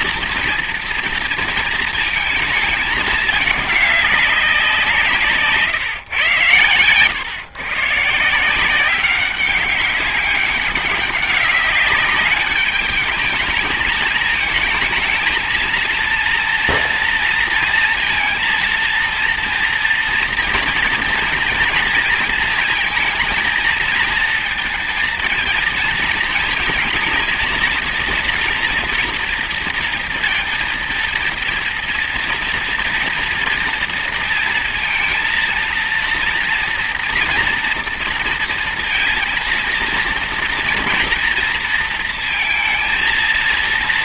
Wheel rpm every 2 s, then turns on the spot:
230, 220, 180, 120, 180, 200, 200, 220, 230, 230, 230, 230, 230, 230, 230, 230, 230, 230, 230, 230, 240, 230.
none